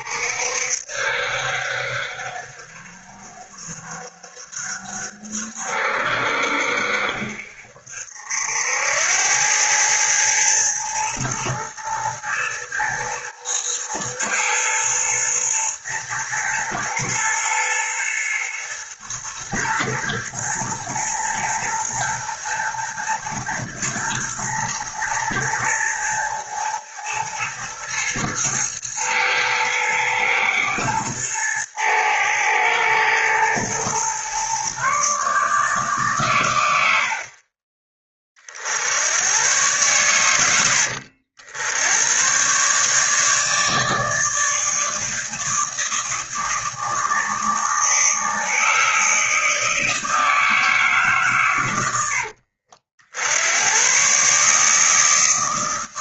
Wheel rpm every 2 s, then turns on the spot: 60, 60, 60, 60, 80, 110, 110, 110, 110, 110, 120, 110, 110, 110, 110, 110, 110, 130, 100, 70, 80, 140, 160, 160, 160, 160, 60, 150.
36-38